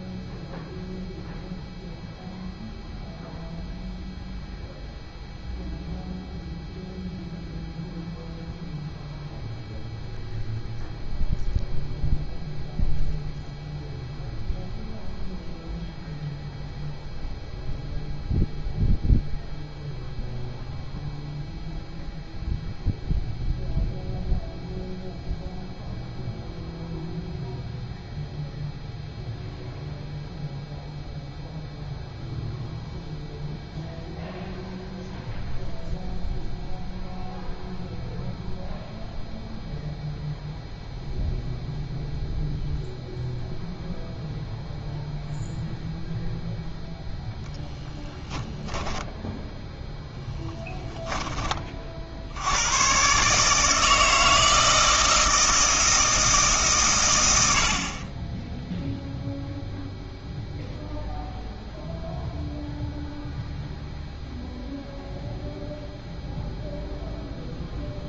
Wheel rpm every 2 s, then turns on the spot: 0, 0, 0, 0, 0, 0, 0, 0, 0, 0, 0, 0, 0, 0, 0, 0, 0, 0, 0, 0, 0, 0, 0, 0, 10, 10, 100, 160, 140, 0, 0, 0, 0, 0.
48-50